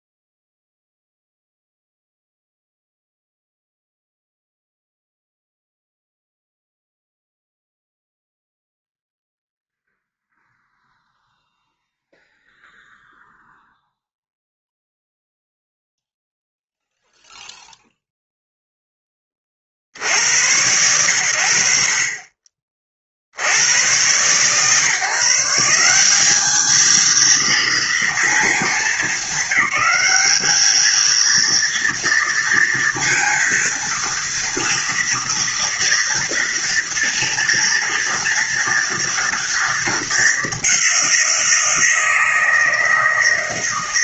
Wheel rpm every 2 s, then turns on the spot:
0, 0, 0, 0, 0, 0, 0, 0, 0, 0, 80, 30, 130, 210, 220, 210, 230, 230, 230, 230, 200, 160.
none